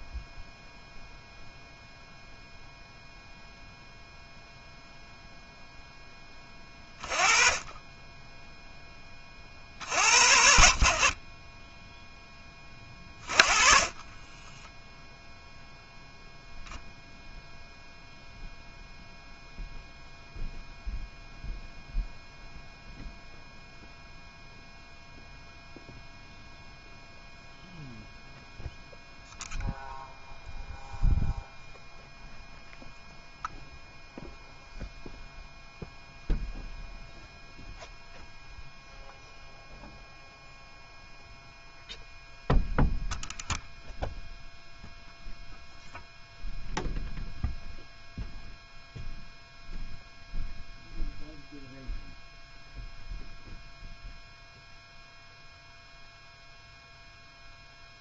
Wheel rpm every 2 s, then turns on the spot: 0, 0, 0, 30, 20, 50, 20, 10, 0, 0, 0, 0, 0, 0, 0, 0, 0, 0, 0, 0, 0, 0, 0, 0, 0, 0, 0, 0, 0.
12-14